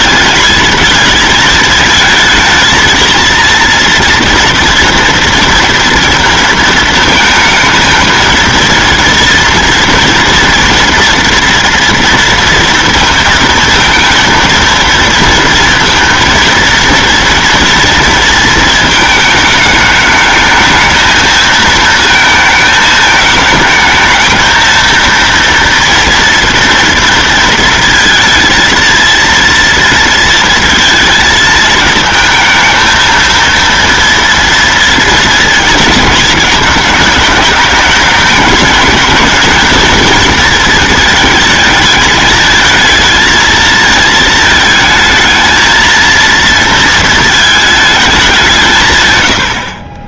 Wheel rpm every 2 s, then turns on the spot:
220, 220, 230, 220, 230, 230, 230, 230, 230, 220, 220, 220, 230, 230, 230, 220, 230, 230, 210, 220, 220, 220, 220, 230, 140.
none